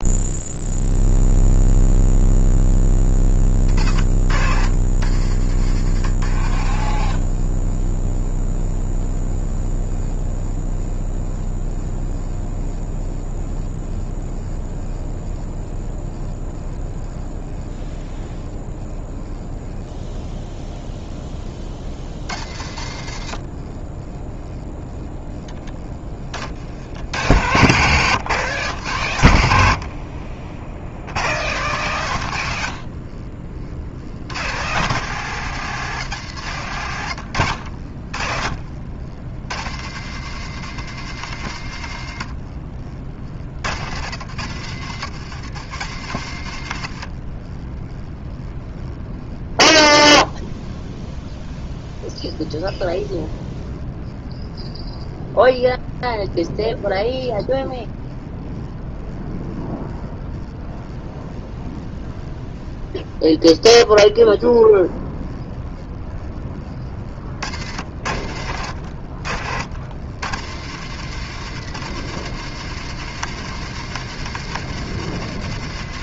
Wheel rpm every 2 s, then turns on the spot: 0, 20, 60, 40, 10, 10, 10, 10, 10, 10, 20, 60, 10, 90, 120, 110, 60, 160, 100, 70, 120, 60, 90, 50, 10, 10, 10, 10, 10, 10, 10, 10, 10, 50, 70, 110, 130, 120.
6-8 30-34 36-40